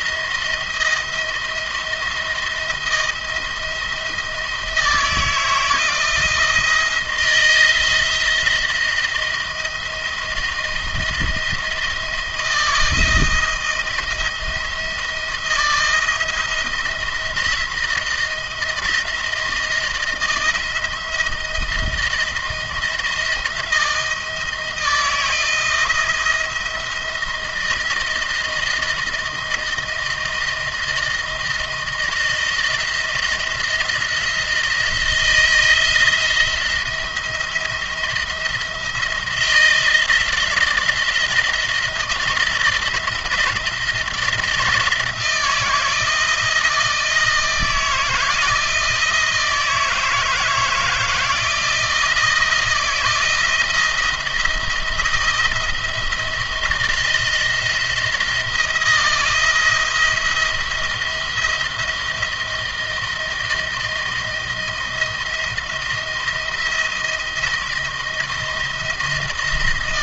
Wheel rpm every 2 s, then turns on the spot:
170, 170, 160, 170, 170, 170, 160, 170, 160, 160, 160, 170, 160, 170, 160, 170, 170, 170, 170, 170, 170, 160, 170, 160, 160, 160, 160, 170, 170, 170, 170, 170, 170, 170, 160.
none